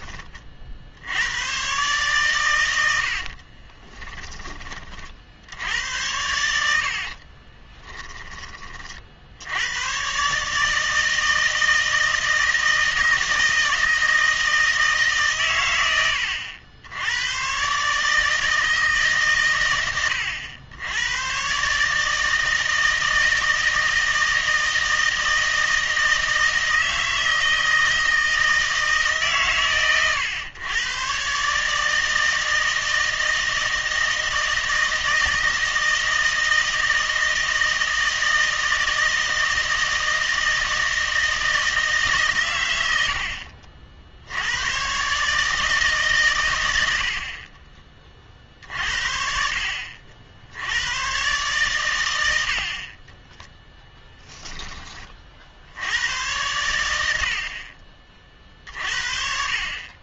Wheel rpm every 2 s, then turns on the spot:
60, 100, 30, 70, 30, 150, 160, 160, 80, 150, 90, 160, 160, 160, 160, 120, 160, 160, 160, 160, 160, 110, 110, 90, 50, 90, 40, 20, 90, 40.
6-8